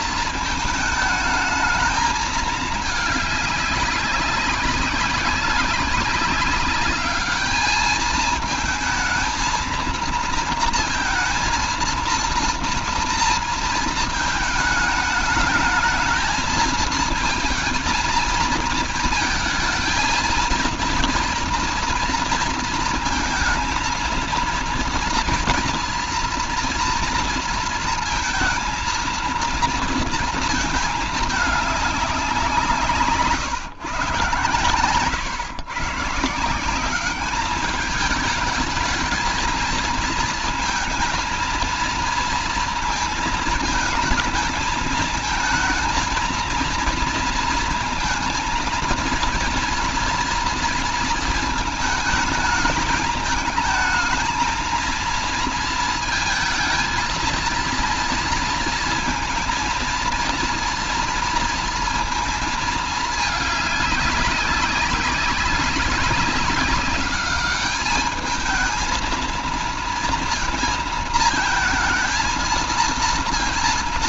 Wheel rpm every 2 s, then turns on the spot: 220, 210, 200, 210, 220, 230, 230, 220, 220, 220, 230, 230, 230, 230, 230, 220, 150, 120, 200, 220, 220, 220, 220, 230, 230, 220, 220, 230, 230, 230, 230, 210, 200, 200, 230, 220, 230.
none